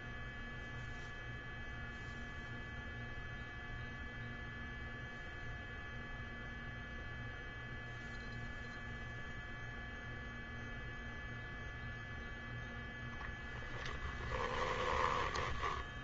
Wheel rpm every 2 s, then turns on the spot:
0, 0, 0, 0, 0, 0, 0, 10.
14-16